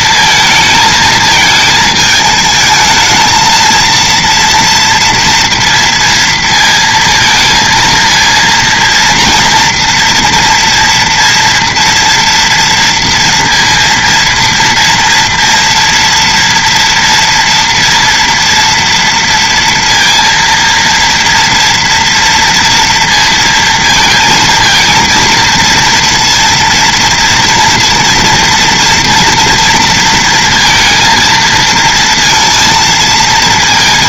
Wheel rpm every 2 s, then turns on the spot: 220, 220, 230, 230, 230, 230, 230, 230, 230, 230, 230, 230, 220, 230, 230, 230, 230.
none